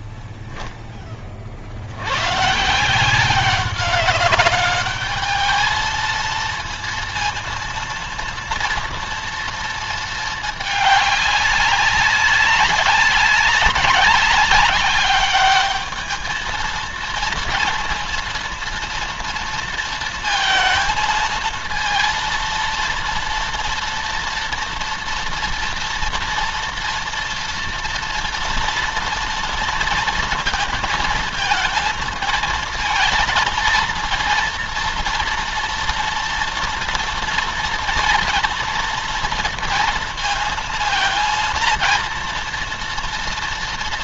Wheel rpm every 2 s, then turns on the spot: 10, 150, 210, 230, 230, 210, 200, 200, 220, 230, 220, 230, 230, 230, 230, 230, 220, 230, 230, 230, 230, 230.
none